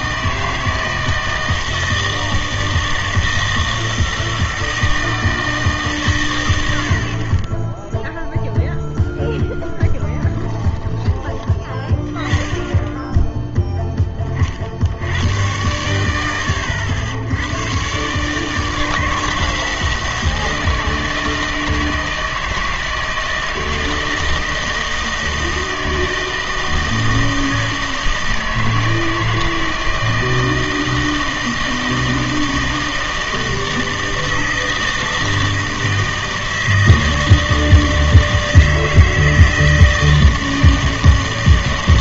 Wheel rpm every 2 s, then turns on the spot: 160, 160, 160, 90, 0, 20, 10, 40, 90, 160, 160, 160, 160, 160, 160, 160, 160, 160, 160, 160, 160.
10-12